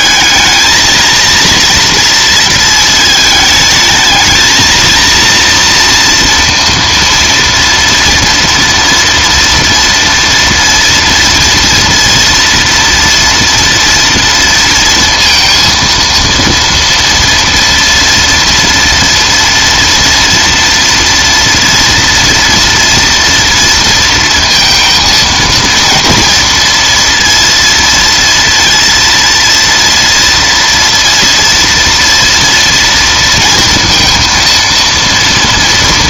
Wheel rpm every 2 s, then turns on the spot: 230, 220, 230, 230, 230, 230, 230, 230, 230, 230, 230, 230, 230, 230, 230, 230, 230, 230.
none